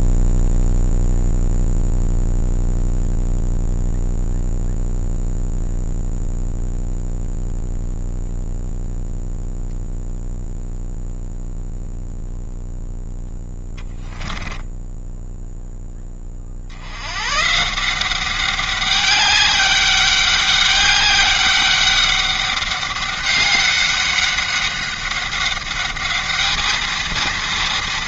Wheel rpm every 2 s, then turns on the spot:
0, 0, 0, 0, 0, 0, 0, 0, 110, 200, 200, 200, 200, 230.
none